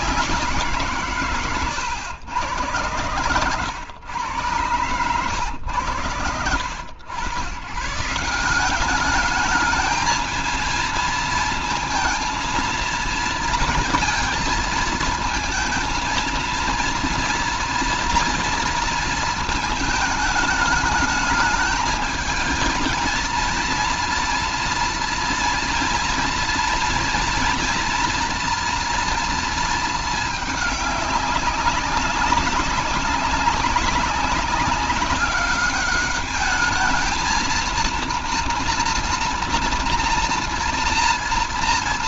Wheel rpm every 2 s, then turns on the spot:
160, 110, 100, 80, 180, 230, 230, 230, 230, 230, 210, 220, 230, 240, 230, 210, 200, 190, 210, 230, 230.
none